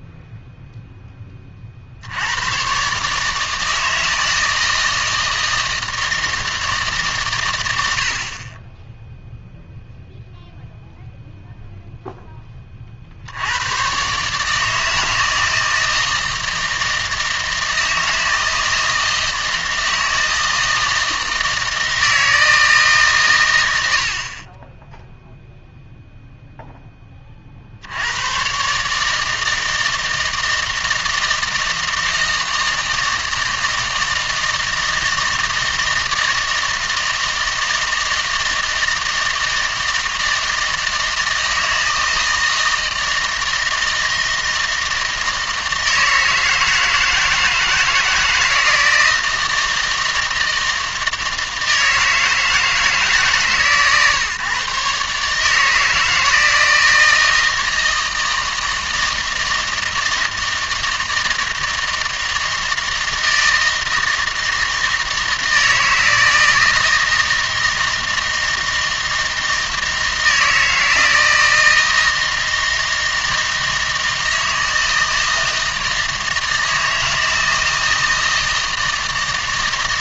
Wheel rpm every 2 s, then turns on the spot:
0, 120, 160, 160, 20, 0, 20, 150, 160, 160, 160, 160, 30, 0, 130, 160, 160, 160, 160, 160, 160, 160, 160, 160, 160, 160, 160, 140, 160, 160, 160, 160, 160, 160, 160, 160, 160, 160, 160, 160.
none